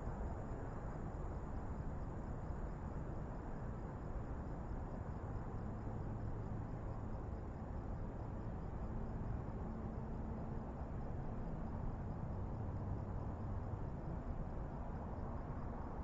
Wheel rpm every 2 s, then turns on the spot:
0, 0, 0, 0, 0, 0, 0, 0.
none